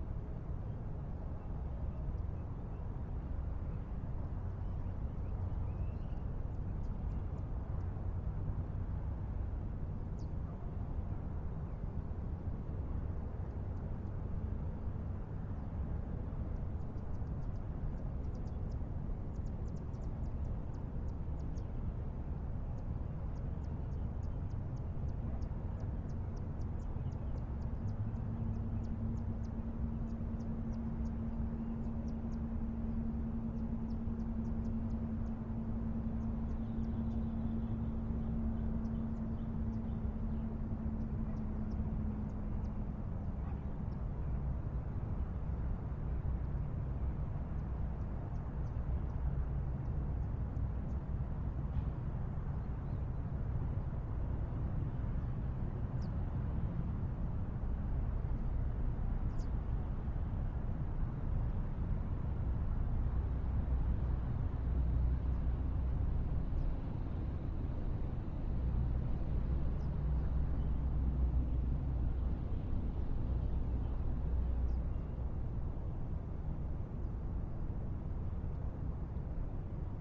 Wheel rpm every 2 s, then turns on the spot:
0, 0, 0, 0, 0, 0, 0, 0, 0, 0, 0, 0, 0, 0, 0, 0, 0, 0, 0, 0, 0, 0, 0, 0, 0, 0, 0, 0, 0, 0, 0, 0, 0, 0, 0, 0, 0, 0, 0, 0.
none